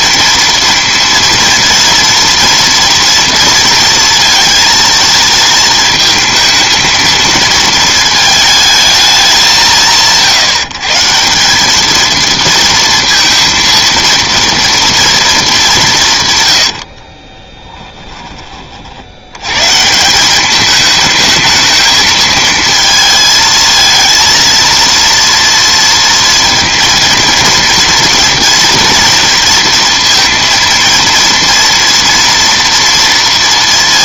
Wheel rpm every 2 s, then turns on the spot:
230, 230, 230, 220, 220, 140, 230, 230, 90, 40, 210, 220, 230, 230, 230, 230, 230.
16-18